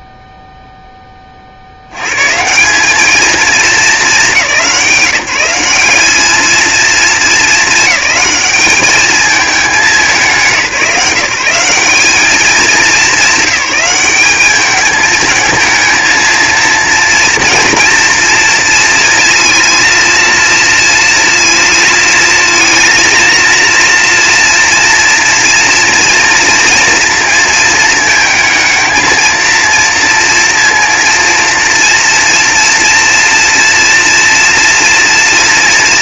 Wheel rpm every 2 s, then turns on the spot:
60, 220, 180, 220, 220, 180, 200, 230, 230, 230, 230, 230, 230, 230, 230, 230, 230, 230.
none